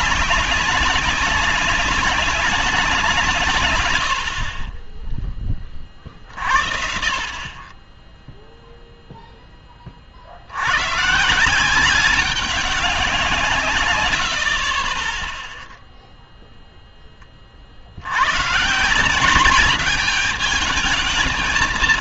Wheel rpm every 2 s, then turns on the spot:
200, 200, 50, 40, 0, 80, 200, 50, 0, 130, 210.
14-16